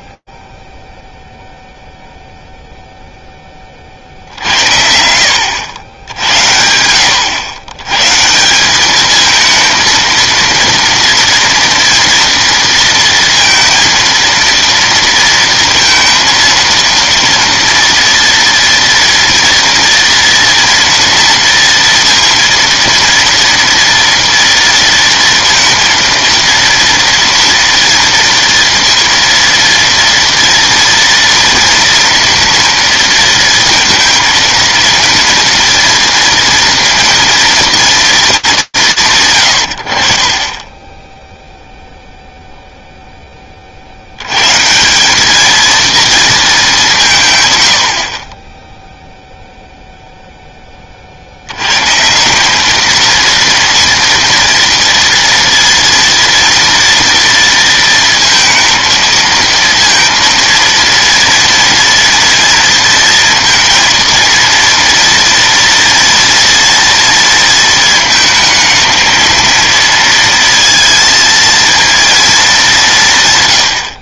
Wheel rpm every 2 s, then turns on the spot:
40, 0, 80, 90, 170, 230, 230, 230, 230, 230, 240, 230, 230, 230, 230, 230, 230, 230, 230, 180, 20, 0, 200, 170, 0, 70, 230, 230, 230, 230, 230, 230, 230, 230, 230, 230, 140.
none